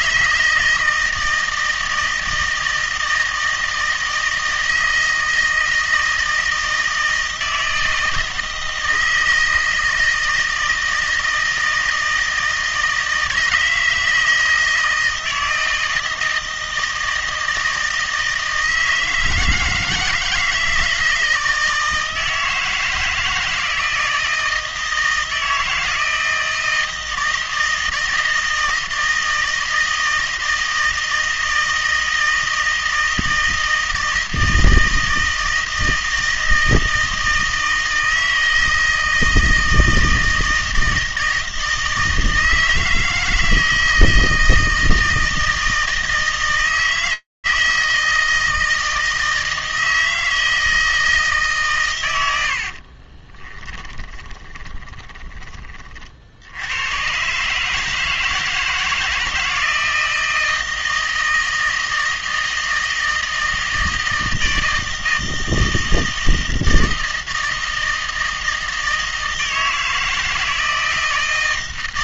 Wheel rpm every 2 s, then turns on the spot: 160, 160, 160, 160, 160, 160, 160, 160, 160, 160, 160, 160, 170, 160, 160, 160, 160, 160, 160, 160, 160, 160, 160, 160, 160, 160, 40, 20, 110, 160, 160, 160, 160, 160, 160, 160.
52-56